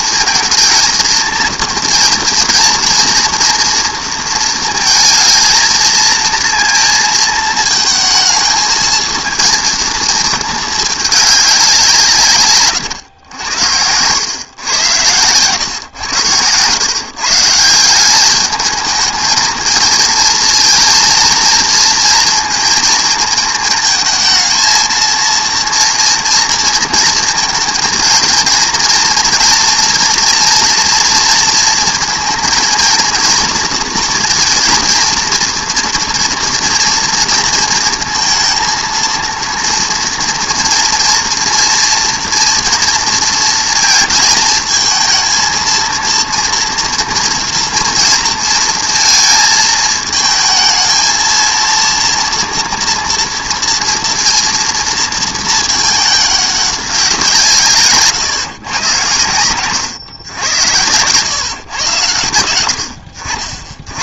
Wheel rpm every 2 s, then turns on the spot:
230, 230, 230, 230, 230, 210, 130, 110, 120, 220, 230, 230, 230, 230, 240, 230, 230, 230, 240, 230, 230, 230, 220, 230, 230, 230, 230, 230, 190, 120, 100, 80.
none